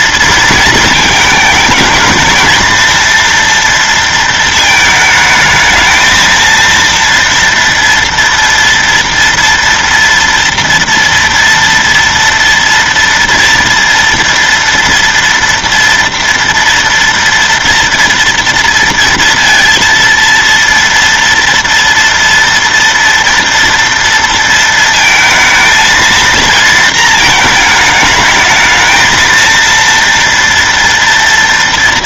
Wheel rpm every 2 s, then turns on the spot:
220, 230, 220, 230, 240, 230, 230, 230, 230, 230, 230, 230, 230, 230, 220, 240.
none